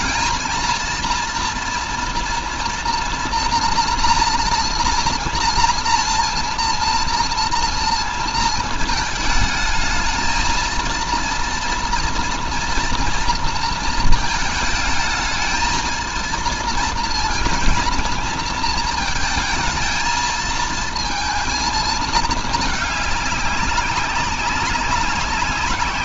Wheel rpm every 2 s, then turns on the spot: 230, 240, 230, 230, 230, 230, 230, 220, 230, 230, 220, 210, 190.
none